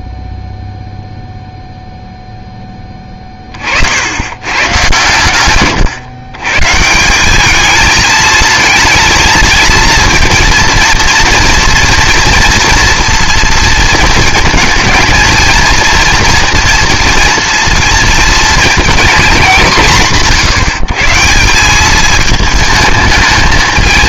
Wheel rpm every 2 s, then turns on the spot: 0, 10, 120, 150, 220, 230, 230, 230, 230, 230, 170, 220.
none